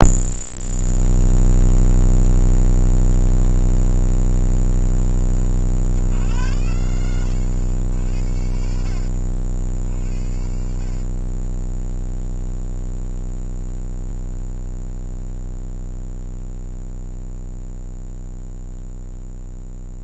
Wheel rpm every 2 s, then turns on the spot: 0, 0, 40, 90, 70, 70, 0, 0, 0, 0.
4-6 10-12